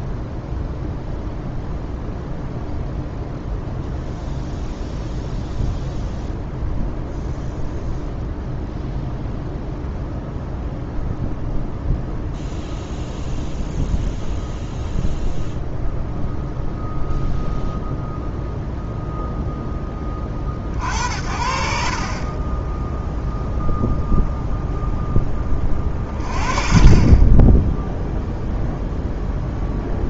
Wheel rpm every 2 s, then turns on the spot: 0, 0, 0, 0, 0, 0, 0, 0, 0, 0, 60, 10, 0, 30, 0.
none